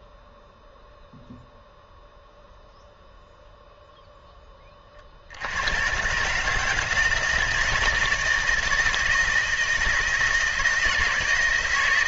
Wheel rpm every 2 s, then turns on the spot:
0, 0, 30, 150, 160, 160.
none